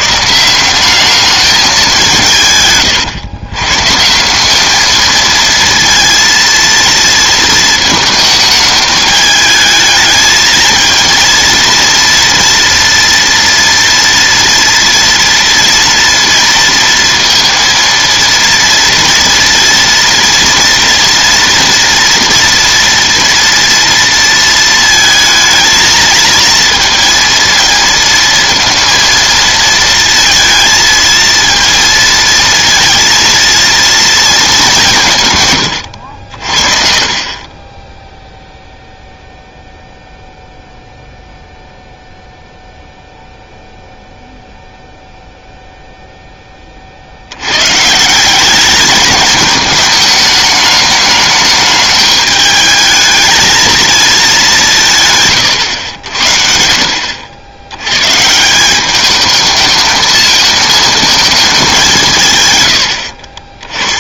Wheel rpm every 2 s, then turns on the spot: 180, 140, 200, 230, 210, 220, 230, 230, 230, 230, 230, 230, 230, 230, 230, 230, 230, 200, 50, 0, 0, 0, 0, 30, 200, 210, 210, 190, 70, 170, 220, 100.
36-38